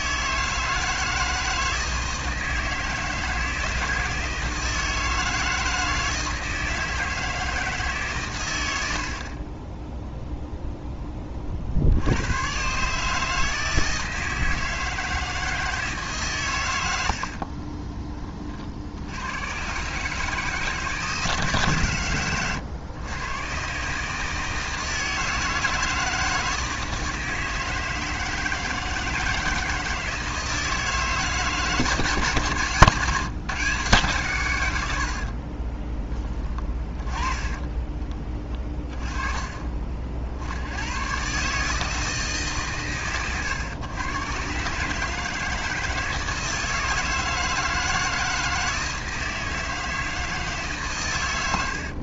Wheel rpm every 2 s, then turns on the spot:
160, 160, 160, 160, 110, 0, 130, 160, 110, 50, 150, 110, 160, 160, 160, 160, 140, 110, 20, 20, 90, 140, 130, 160, 160, 140.
38-40